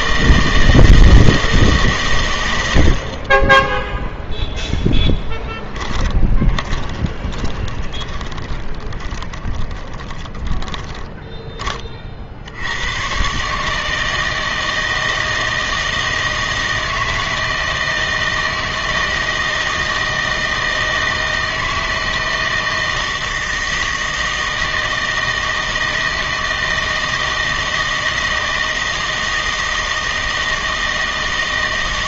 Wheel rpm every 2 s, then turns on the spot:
160, 80, 0, 20, 20, 10, 80, 160, 160, 160, 160, 160, 160, 160, 160, 160.
6-12